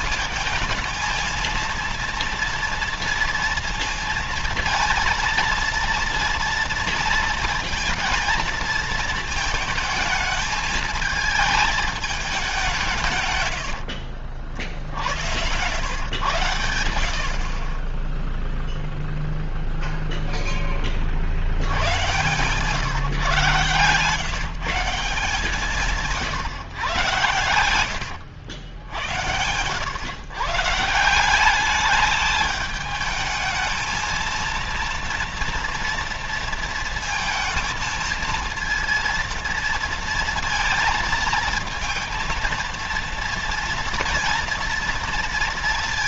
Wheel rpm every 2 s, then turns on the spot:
220, 230, 230, 230, 230, 220, 180, 60, 80, 0, 20, 140, 160, 130, 90, 150, 210, 230, 230, 230, 230, 230, 240.
none